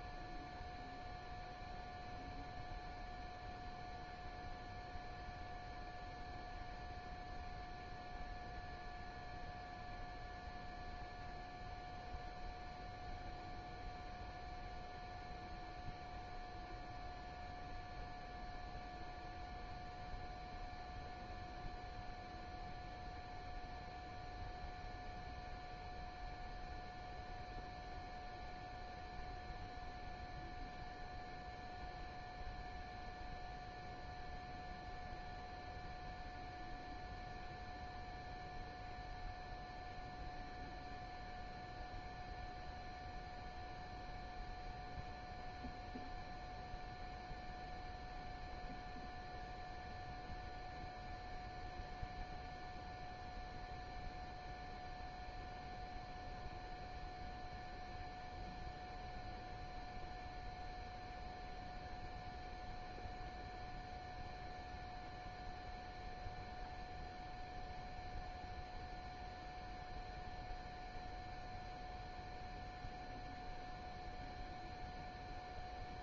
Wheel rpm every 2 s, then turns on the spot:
0, 0, 0, 0, 0, 0, 0, 0, 0, 0, 0, 0, 0, 0, 0, 0, 0, 0, 0, 0, 0, 0, 0, 0, 0, 0, 0, 0, 0, 0, 0, 0, 0, 0, 0, 0, 0, 0.
none